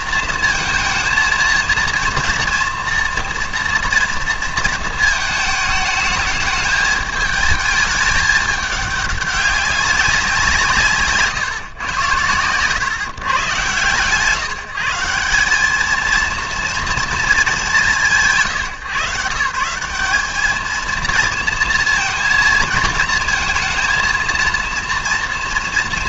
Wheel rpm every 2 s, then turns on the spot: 230, 230, 230, 210, 210, 180, 120, 160, 230, 140, 220, 220, 230.
none